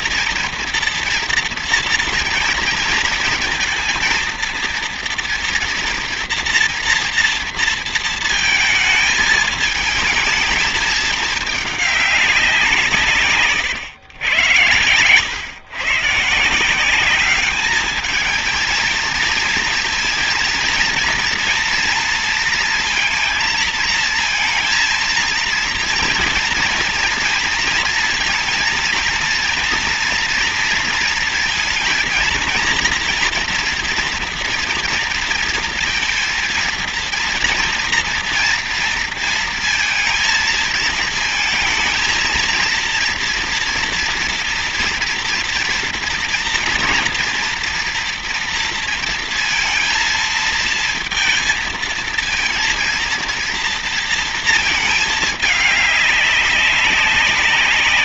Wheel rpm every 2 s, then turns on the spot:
230, 230, 230, 230, 220, 220, 150, 100, 190, 220, 230, 230, 220, 230, 230, 230, 230, 230, 230, 230, 220, 230, 230, 230, 230, 230, 230, 220, 200.
none